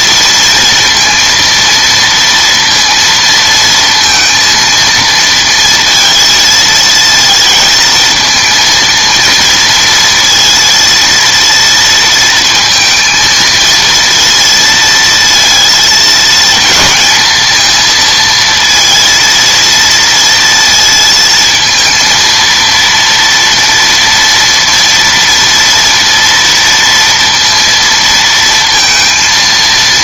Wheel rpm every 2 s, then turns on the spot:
230, 230, 230, 230, 230, 230, 230, 230, 220, 230, 230, 230, 230, 230, 230.
none